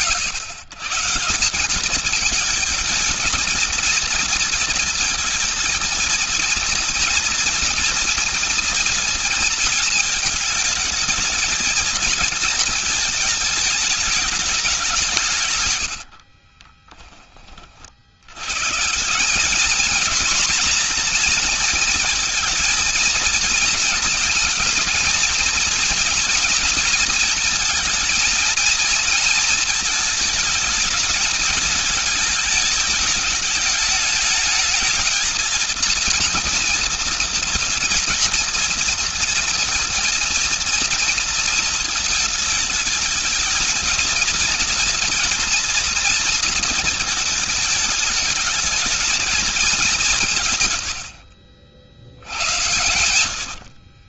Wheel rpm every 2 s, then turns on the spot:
140, 220, 230, 230, 230, 220, 220, 200, 40, 140, 240, 230, 240, 240, 230, 220, 210, 220, 230, 230, 230, 220, 230, 230, 220, 120, 80.
16-18 50-52